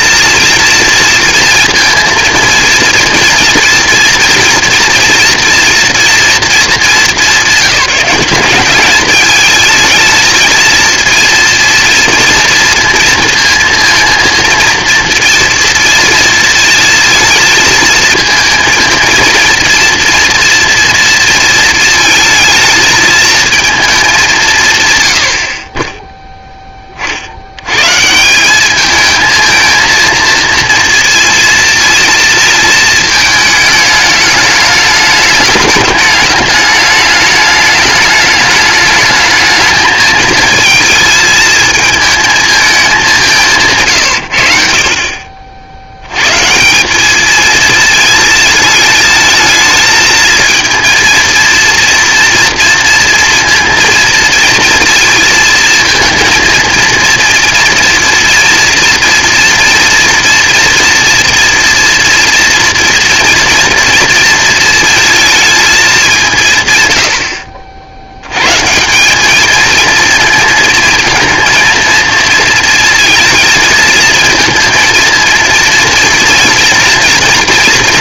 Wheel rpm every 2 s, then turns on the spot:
230, 230, 230, 200, 210, 230, 220, 230, 230, 230, 230, 220, 80, 40, 220, 230, 220, 210, 210, 220, 230, 190, 50, 200, 220, 230, 240, 230, 230, 230, 230, 240, 230, 100, 170, 220, 230, 230, 240.
none